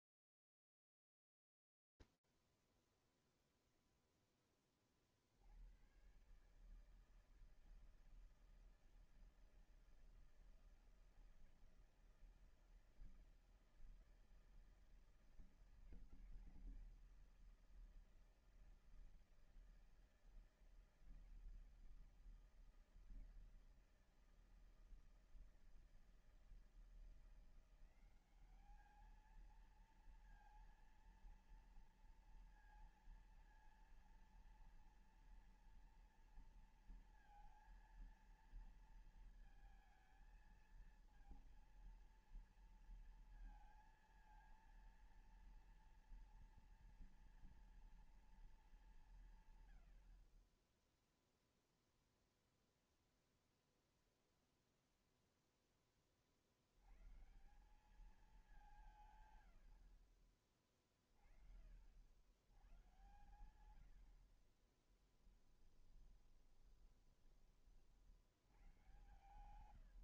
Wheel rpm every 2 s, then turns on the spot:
0, 0, 0, 110, 160, 160, 160, 160, 170, 160, 160, 160, 160, 170, 210, 240, 230, 230, 230, 220, 230, 230, 230, 230, 200, 20, 0, 0, 110, 180, 40, 110, 20, 20, 110.
58-60 64-66